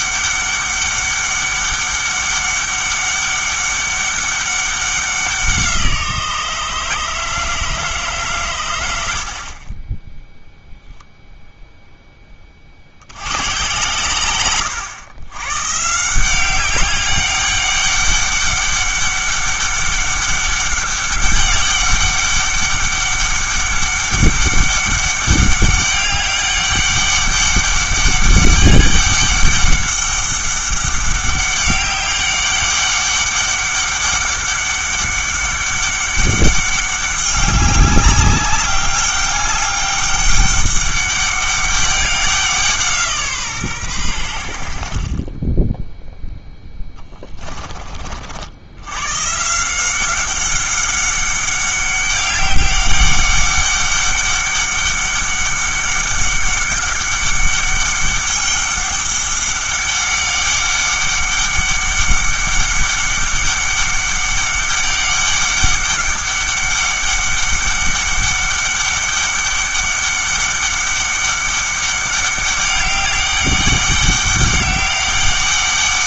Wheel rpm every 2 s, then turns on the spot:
200, 200, 190, 160, 110, 0, 50, 110, 190, 200, 200, 200, 200, 200, 200, 200, 200, 200, 200, 200, 200, 170, 70, 10, 80, 190, 200, 200, 200, 200, 200, 200, 200, 200, 200, 200, 200, 200.
46-48